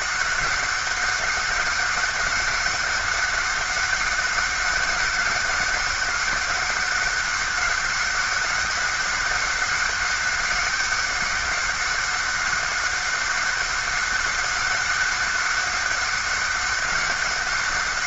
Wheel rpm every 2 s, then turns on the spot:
200, 200, 200, 200, 190, 200, 190, 200, 190.
none